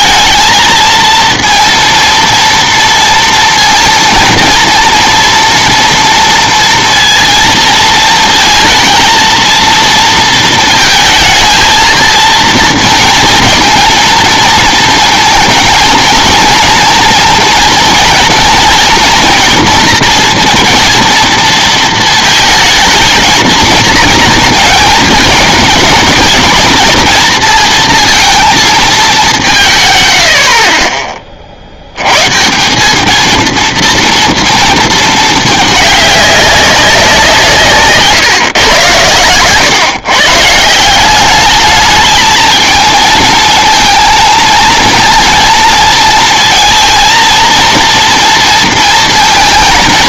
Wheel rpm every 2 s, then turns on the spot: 220, 230, 230, 230, 230, 230, 230, 230, 230, 230, 230, 220, 230, 220, 220, 40, 170, 230, 200, 120, 150, 220, 220, 230, 230.
none